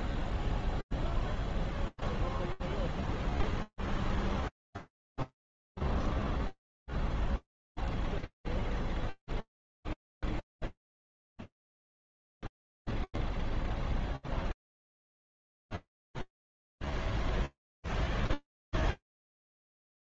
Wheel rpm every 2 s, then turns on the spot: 0, 0, 0, 0, 0, 0, 0, 0, 0, 0.
none